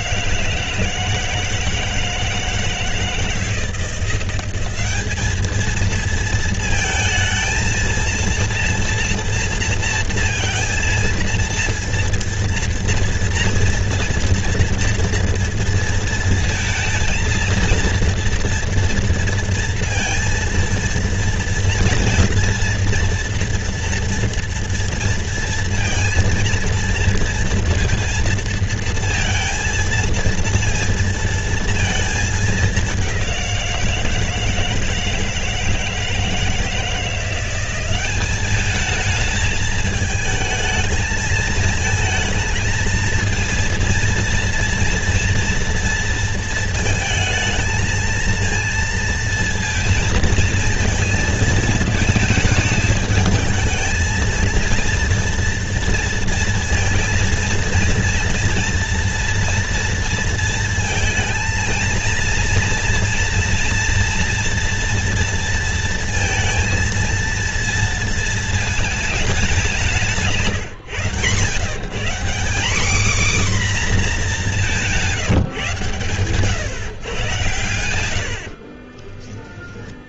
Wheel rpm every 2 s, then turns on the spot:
160, 160, 190, 220, 230, 230, 230, 240, 230, 230, 230, 240, 230, 230, 230, 230, 210, 160, 160, 210, 220, 220, 230, 230, 230, 230, 220, 230, 230, 230, 230, 230, 240, 230, 220, 140, 220, 190, 130, 50.
78-80